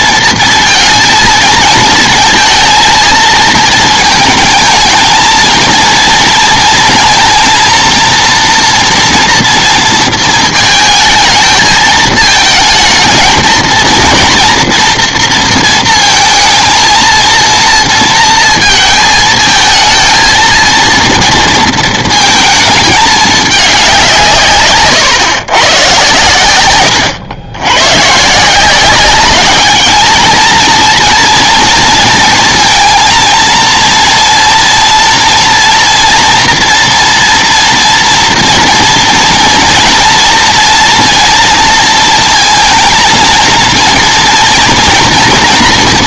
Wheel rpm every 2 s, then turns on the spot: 230, 220, 220, 230, 240, 220, 220, 240, 230, 220, 230, 220, 130, 110, 190, 230, 230, 230, 230, 230, 230, 230, 240.
24-26